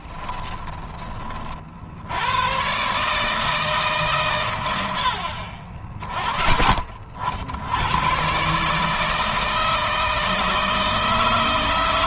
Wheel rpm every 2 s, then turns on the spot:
30, 130, 90, 50, 150, 160.
none